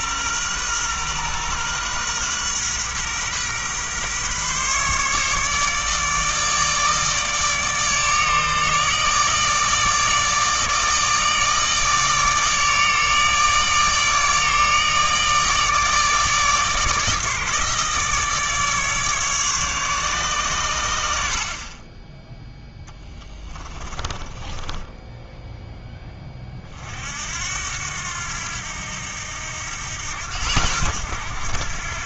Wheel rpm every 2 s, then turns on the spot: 120, 130, 140, 150, 150, 160, 150, 150, 150, 150, 90, 10, 10, 50, 80, 90.
22-26